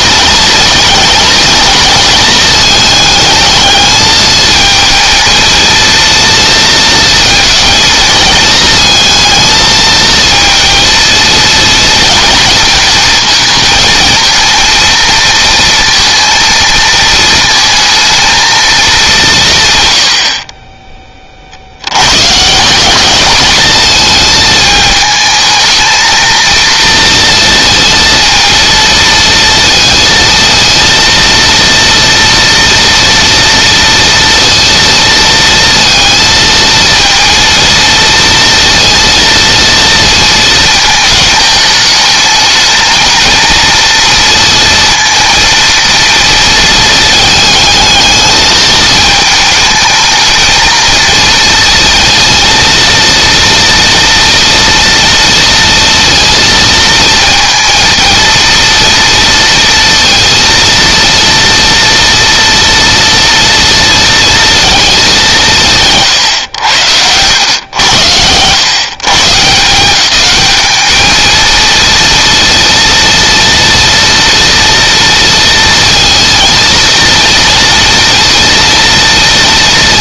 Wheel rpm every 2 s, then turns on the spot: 220, 220, 220, 230, 220, 230, 230, 230, 230, 210, 20, 200, 220, 230, 230, 230, 230, 230, 230, 230, 220, 220, 230, 220, 220, 230, 230, 230, 230, 230, 230, 230, 220, 90, 140, 210, 230, 230, 230, 240.
none